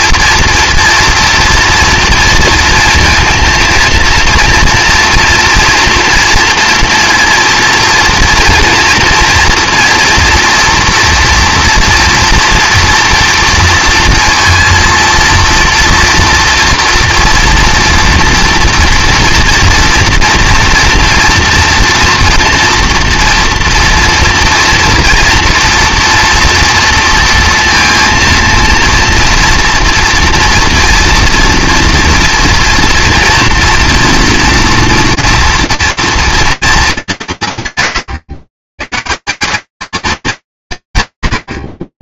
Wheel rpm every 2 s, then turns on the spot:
230, 230, 240, 240, 230, 230, 230, 230, 230, 230, 240, 230, 230, 230, 230, 230, 230, 230, 220, 110, 180.
none